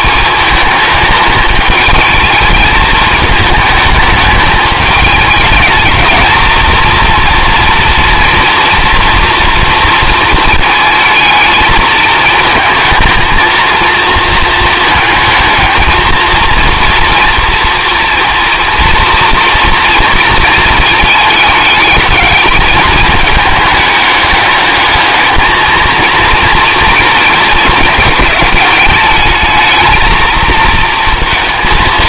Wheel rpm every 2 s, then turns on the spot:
210, 210, 210, 230, 230, 220, 220, 220, 230, 230, 220, 210, 210, 230, 220, 230.
none